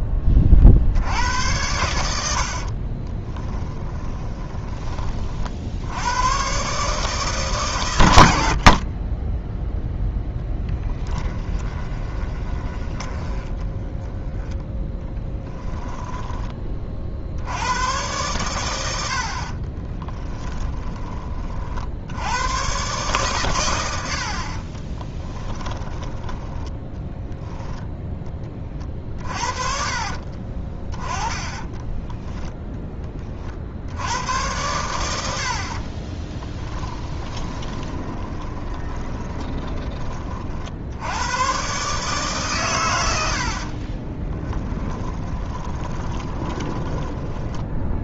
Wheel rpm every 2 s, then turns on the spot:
50, 50, 20, 130, 50, 10, 10, 10, 30, 100, 10, 120, 60, 10, 30, 30, 10, 100, 10, 20, 60, 120, 20, 20.
2-6 8-10 12-16 20-22 24-32 36-40 44-48